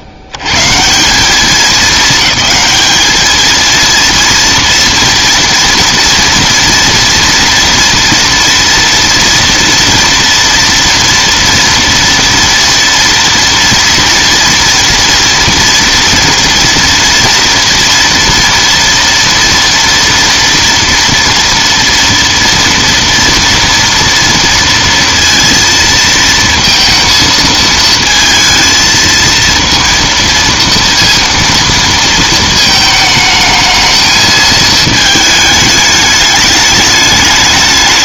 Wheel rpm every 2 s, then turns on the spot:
100, 210, 240, 230, 230, 240, 230, 230, 230, 230, 230, 230, 230, 230, 220, 230, 220, 220, 210.
none